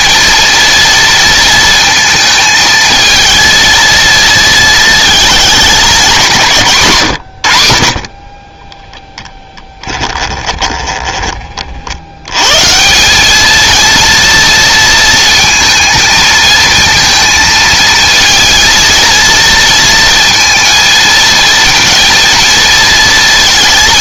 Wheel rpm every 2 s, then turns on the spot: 230, 220, 220, 150, 10, 20, 130, 230, 230, 230, 230, 230.
8-12